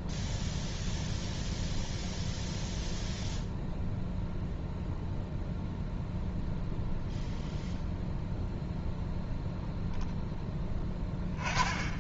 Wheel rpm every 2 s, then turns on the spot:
0, 0, 0, 0, 0, 10.
10-12